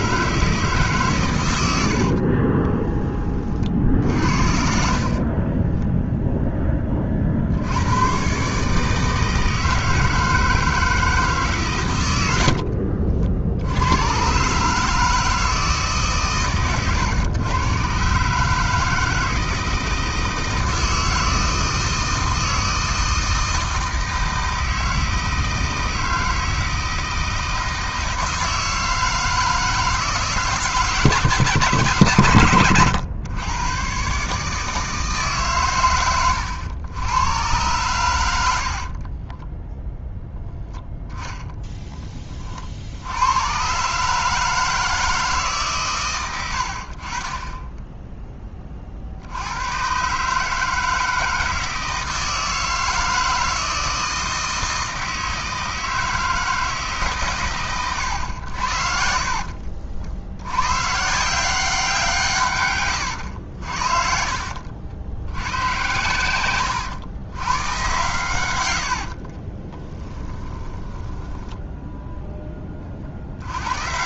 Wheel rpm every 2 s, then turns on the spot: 140, 20, 50, 20, 150, 160, 60, 150, 120, 160, 160, 160, 160, 160, 160, 150, 110, 160, 110, 40, 10, 70, 160, 50, 40, 160, 160, 160, 150, 60, 130, 120, 80, 100, 80, 10, 50.
4-6 12-14 38-42 58-60 62-64 68-72